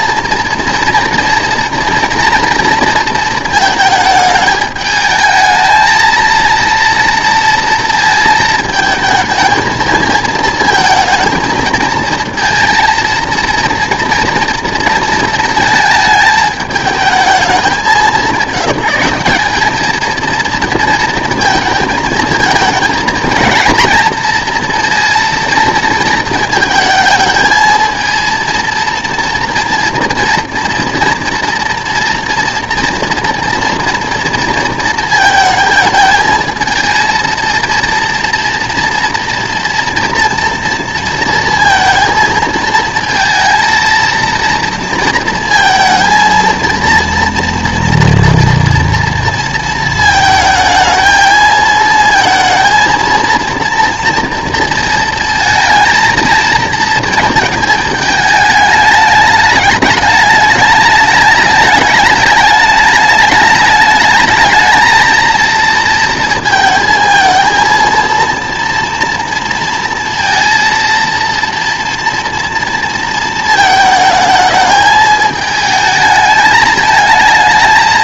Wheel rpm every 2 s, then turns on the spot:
230, 230, 220, 230, 220, 220, 220, 230, 210, 190, 230, 230, 230, 220, 230, 230, 230, 230, 230, 230, 230, 220, 230, 230, 230, 220, 230, 230, 230, 210, 210, 210, 220, 220, 230, 230, 230, 220, 220.
none